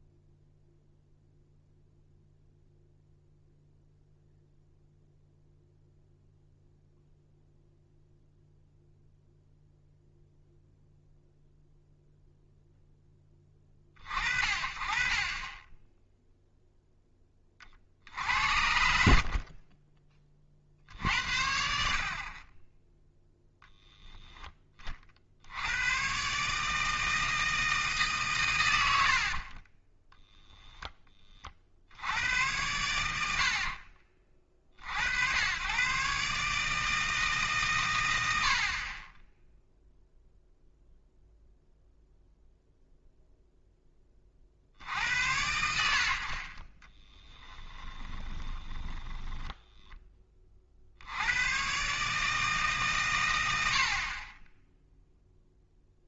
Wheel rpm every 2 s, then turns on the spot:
0, 0, 0, 0, 0, 0, 0, 40, 0, 70, 50, 10, 20, 150, 90, 0, 100, 50, 150, 70, 0, 0, 60, 30, 10, 30, 150, 10.
18-20 46-50